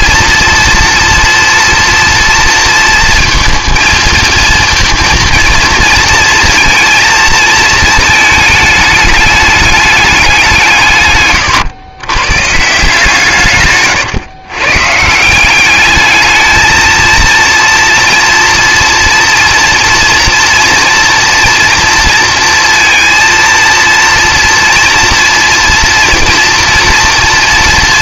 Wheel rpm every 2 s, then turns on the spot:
230, 230, 230, 230, 220, 160, 150, 130, 220, 240, 240, 230, 230, 230.
none